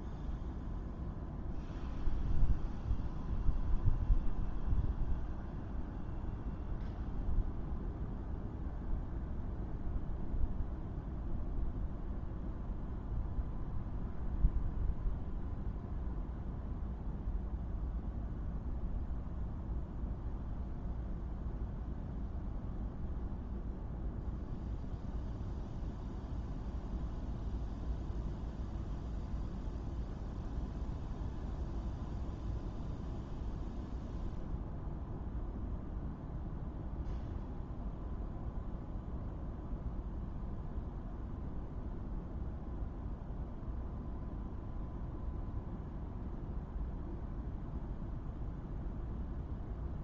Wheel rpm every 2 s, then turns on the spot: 0, 0, 0, 0, 0, 0, 0, 0, 0, 0, 0, 0, 0, 0, 0, 0, 0, 0, 0, 0, 0, 0, 0, 0, 0.
none